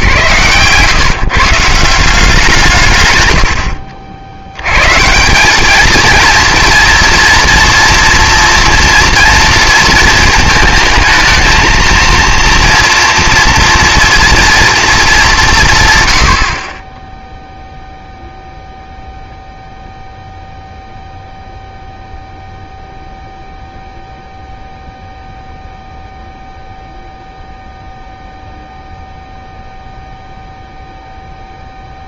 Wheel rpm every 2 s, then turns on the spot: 140, 150, 100, 230, 240, 220, 240, 230, 40, 0, 0, 0, 0, 0, 0, 0.
none